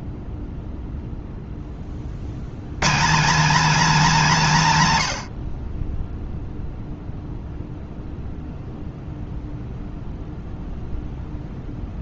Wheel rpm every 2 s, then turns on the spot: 0, 130, 170, 0, 0, 0.
none